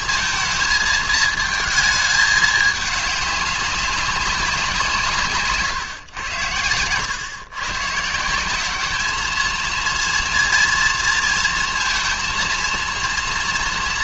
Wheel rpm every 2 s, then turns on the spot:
220, 210, 180, 100, 190, 230, 230.
none